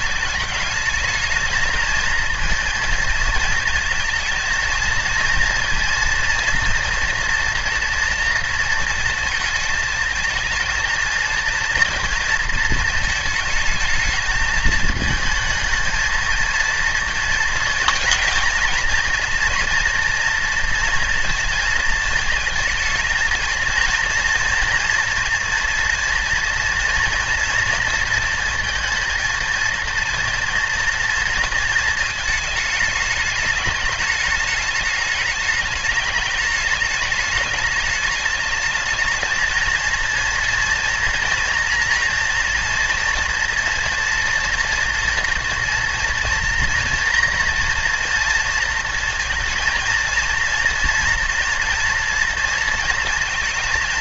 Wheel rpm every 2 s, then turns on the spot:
220, 230, 230, 230, 230, 220, 230, 220, 230, 240, 230, 220, 240, 230, 230, 230, 210, 210, 210, 210, 230, 230, 230, 230, 230, 230, 230.
none